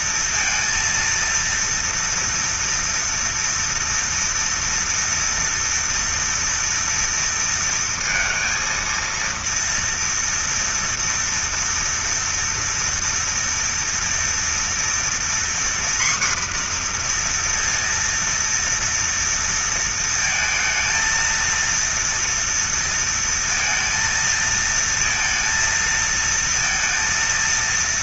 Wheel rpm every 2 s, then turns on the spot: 230, 230, 230, 230, 230, 230, 230, 240, 240, 230, 230, 230, 230, 230.
none